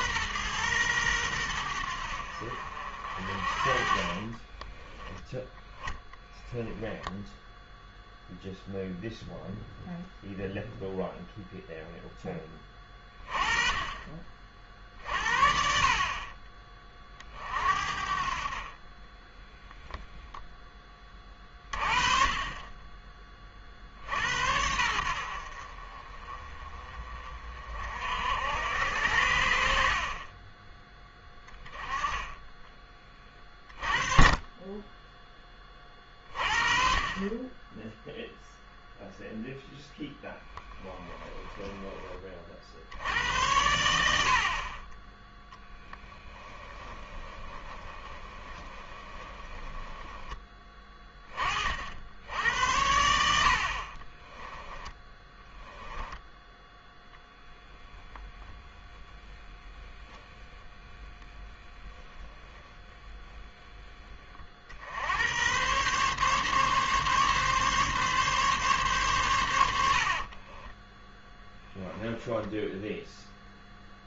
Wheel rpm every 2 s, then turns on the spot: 120, 50, 20, 10, 0, 0, 20, 50, 40, 30, 10, 20, 80, 30, 80, 10, 20, 10, 30, 0, 10, 70, 30, 10, 20, 20, 80, 10, 10, 10, 10, 10, 70, 140, 130, 20, 0.
4-8 40-42 46-50 54-56 62-64 70-72